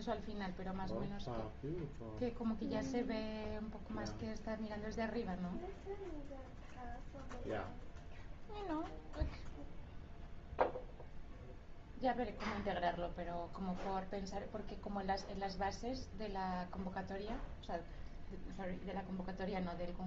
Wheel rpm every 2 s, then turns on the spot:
0, 0, 0, 0, 0, 0, 0, 0, 0, 0.
none